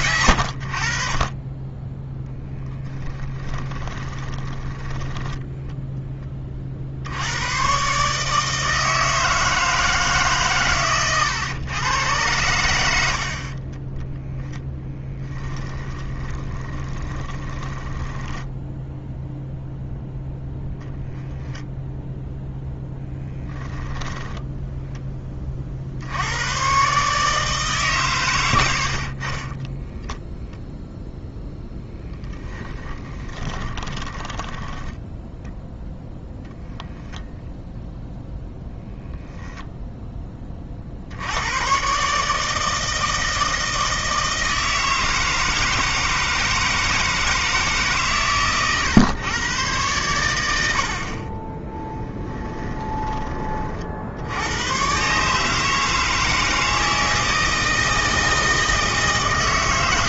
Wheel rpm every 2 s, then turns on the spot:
60, 20, 10, 60, 160, 120, 80, 10, 20, 0, 0, 0, 10, 130, 60, 0, 10, 10, 0, 10, 60, 160, 160, 160, 120, 60, 20, 130, 160, 160.
2-6 14-18 28-30 32-34 52-54